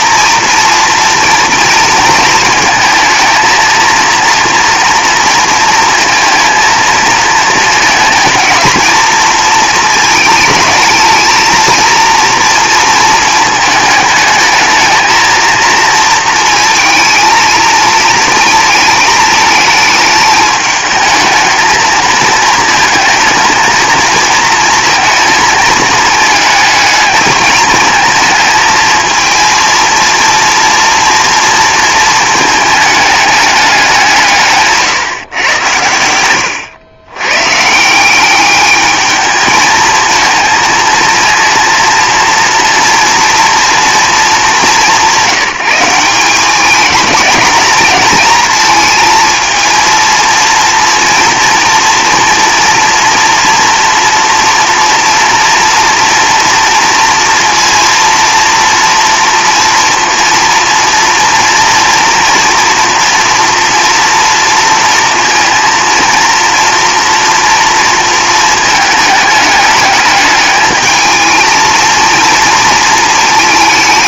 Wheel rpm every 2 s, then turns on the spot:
230, 230, 230, 230, 230, 220, 230, 220, 220, 220, 220, 220, 220, 210, 230, 230, 220, 150, 100, 210, 230, 240, 200, 200, 230, 230, 230, 230, 230, 230, 230, 230, 230, 230, 220, 210, 230.
34-36